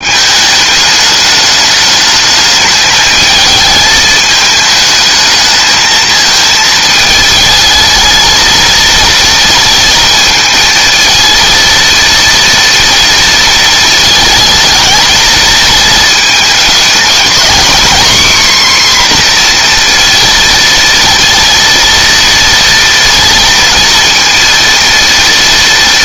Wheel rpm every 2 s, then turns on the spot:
210, 220, 220, 220, 230, 220, 230, 220, 220, 260, 230, 230, 230.
none